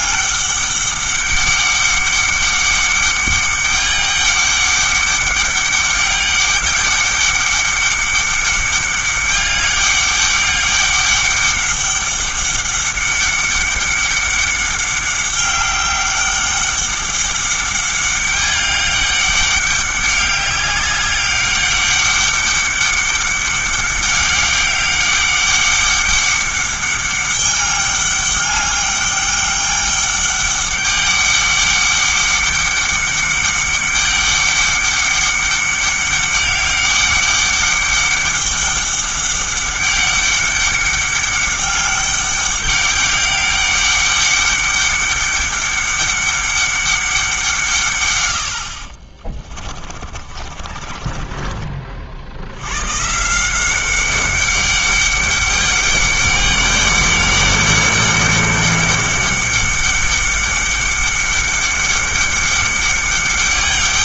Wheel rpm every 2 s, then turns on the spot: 200, 200, 200, 200, 200, 200, 200, 200, 200, 200, 200, 200, 200, 200, 200, 200, 200, 200, 200, 200, 200, 200, 200, 200, 50, 30, 120, 200, 200, 200, 200, 200.
50-52